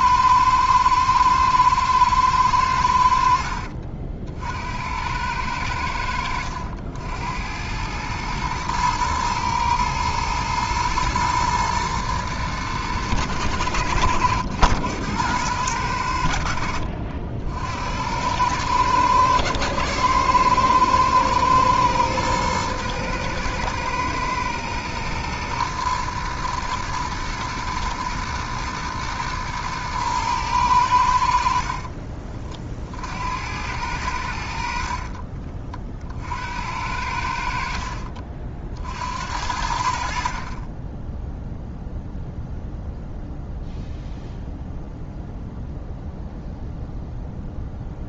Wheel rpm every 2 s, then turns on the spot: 110, 100, 70, 80, 110, 110, 110, 90, 70, 100, 110, 120, 120, 110, 110, 100, 40, 70, 70, 50, 30, 0, 0, 0.
none